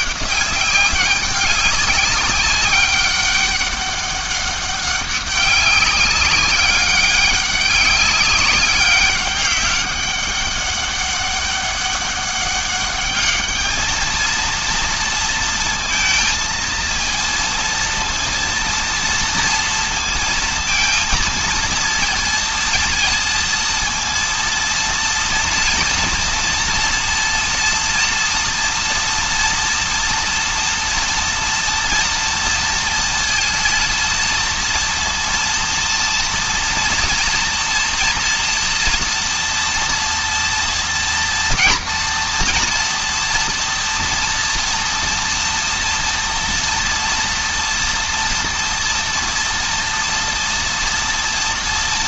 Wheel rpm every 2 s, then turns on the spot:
190, 200, 200, 200, 200, 200, 210, 230, 230, 230, 230, 230, 230, 230, 230, 230, 230, 230, 230, 230, 230, 240, 230, 230, 230, 240.
none